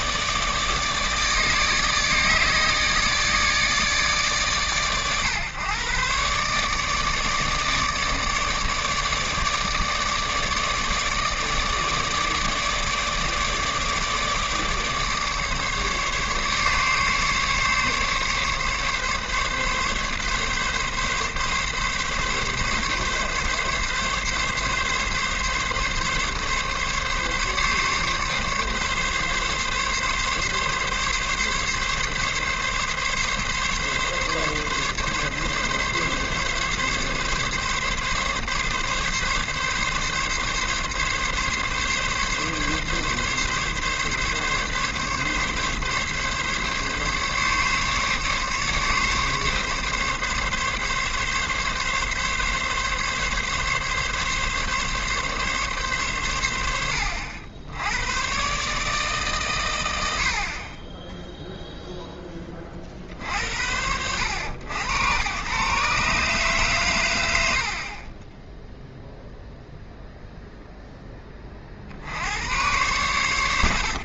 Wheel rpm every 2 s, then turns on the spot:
150, 150, 130, 150, 150, 150, 150, 150, 140, 140, 140, 140, 140, 140, 140, 140, 140, 140, 140, 140, 140, 140, 140, 140, 140, 140, 140, 140, 80, 140, 40, 20, 100, 130, 0, 0, 100.
none